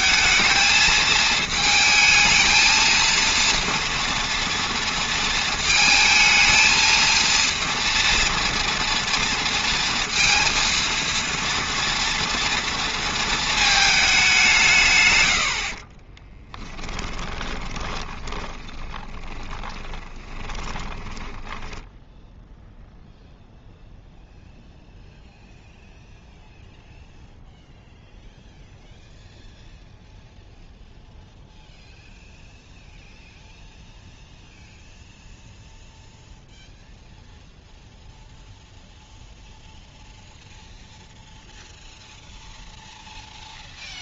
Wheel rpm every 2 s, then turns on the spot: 220, 230, 230, 230, 230, 230, 230, 140, 20, 20, 20, 0, 0, 0, 0, 0, 0, 0, 0, 0, 0, 0.
16-22